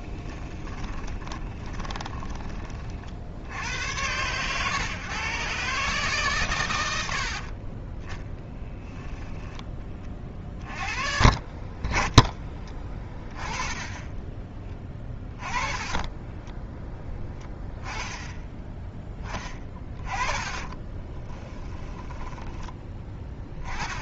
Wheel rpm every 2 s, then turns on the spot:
20, 30, 130, 80, 10, 30, 10, 10, 10, 10, 20, 10.
0-2 14-16 20-22